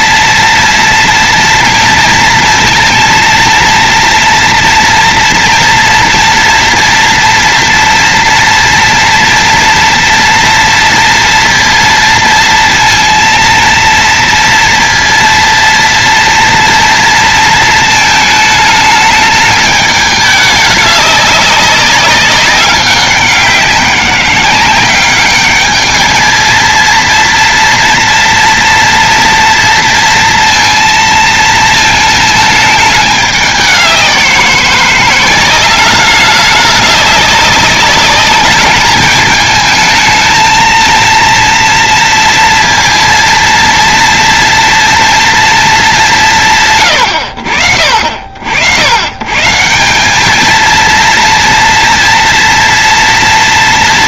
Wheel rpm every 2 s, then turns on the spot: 230, 230, 230, 230, 230, 230, 230, 230, 230, 210, 200, 190, 200, 230, 230, 230, 210, 180, 200, 220, 230, 230, 230, 100, 130, 230, 230.
none